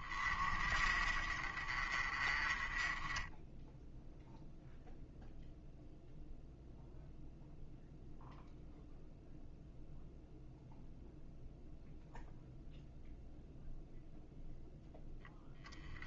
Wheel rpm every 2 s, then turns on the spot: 40, 20, 0, 0, 0, 0, 0, 0.
none